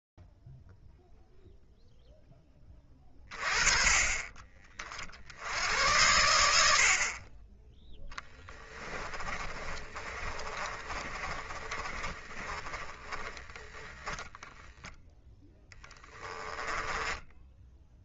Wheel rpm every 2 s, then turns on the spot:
0, 10, 40, 110, 20, 40, 20, 0, 10.
8-14 16-18